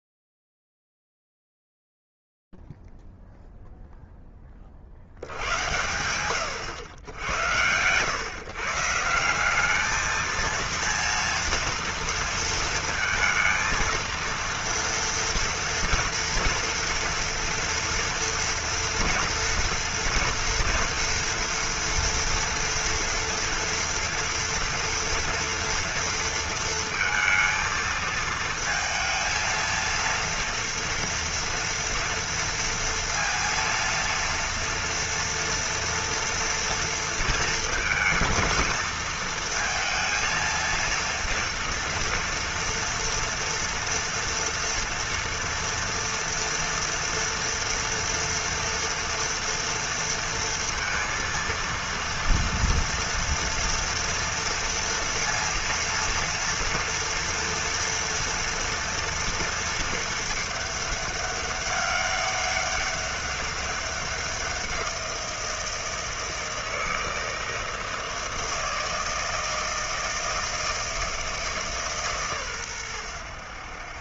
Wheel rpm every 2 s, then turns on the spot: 0, 0, 0, 90, 100, 200, 230, 230, 230, 230, 230, 230, 230, 230, 220, 230, 230, 230, 230, 230, 230, 230, 230, 230, 230, 230, 230, 230, 230, 230, 220, 200, 190, 160, 160, 160, 130.
none